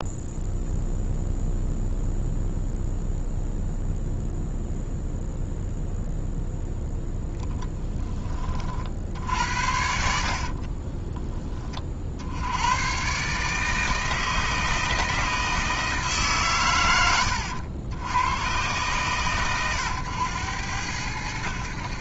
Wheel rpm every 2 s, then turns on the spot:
0, 0, 0, 0, 30, 40, 80, 160, 140, 90, 100.
10-12